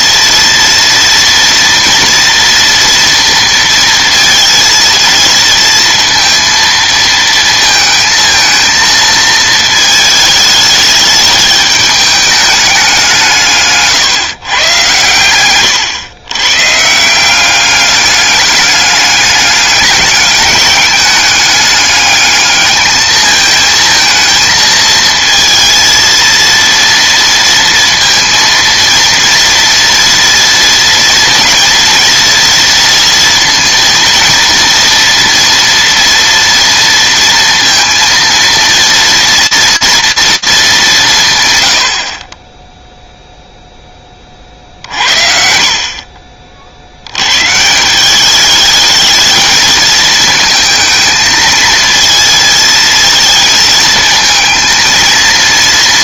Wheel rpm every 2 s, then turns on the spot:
230, 230, 230, 230, 220, 210, 200, 130, 130, 200, 200, 220, 230, 230, 230, 230, 230, 230, 230, 230, 210, 10, 50, 60, 220, 220, 220, 220.
none